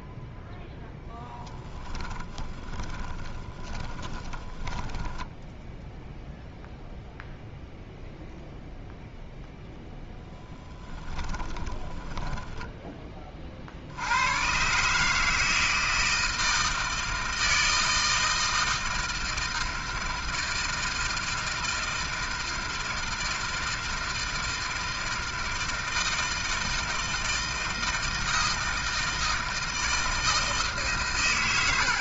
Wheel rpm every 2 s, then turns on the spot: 0, 10, 20, 0, 0, 10, 10, 120, 160, 160, 160, 160, 160, 160, 160, 160.
2-6 10-14